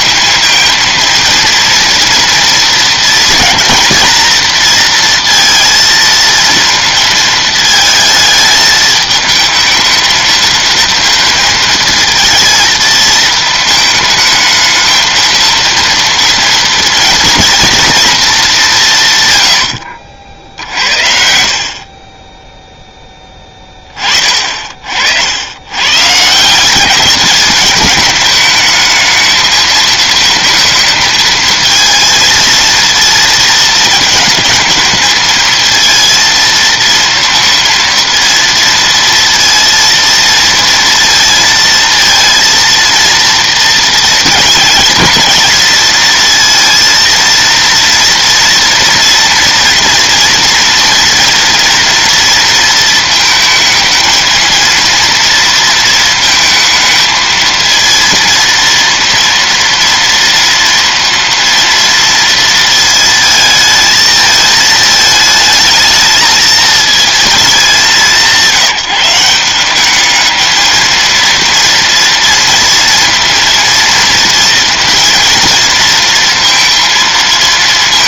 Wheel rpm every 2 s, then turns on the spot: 230, 230, 230, 230, 220, 220, 220, 220, 230, 170, 60, 0, 40, 180, 210, 220, 230, 220, 230, 230, 230, 230, 230, 230, 230, 230, 230, 230, 220, 230, 230, 230, 220, 230, 180, 220, 230, 230, 230.
none